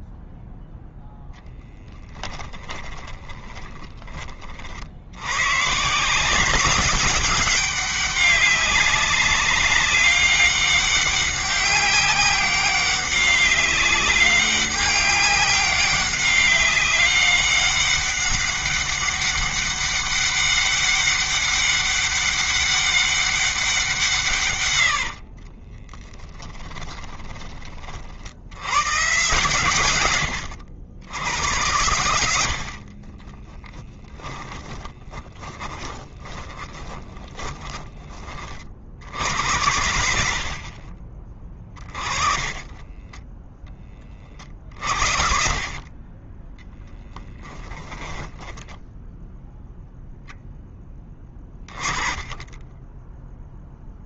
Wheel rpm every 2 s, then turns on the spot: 0, 20, 70, 190, 190, 190, 190, 200, 200, 200, 200, 200, 90, 20, 110, 90, 60, 20, 10, 60, 40, 10, 60, 10, 10, 10, 10.
2-4 24-26 32-38 42-44 46-48